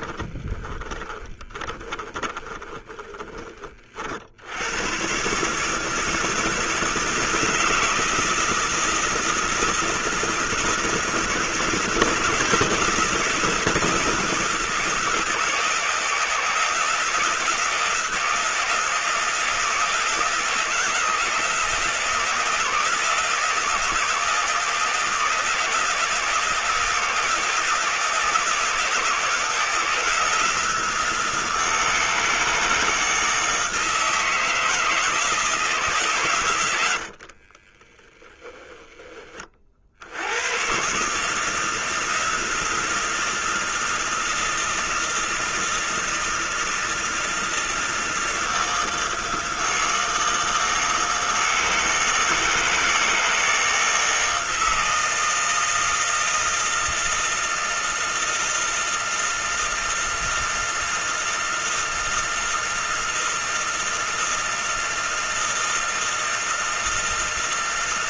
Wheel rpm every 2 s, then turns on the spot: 20, 30, 110, 160, 160, 160, 160, 160, 170, 160, 160, 160, 160, 160, 160, 170, 160, 160, 90, 10, 140, 160, 160, 160, 160, 160, 160, 160, 160, 160, 160, 160, 160, 160.
0-4 36-38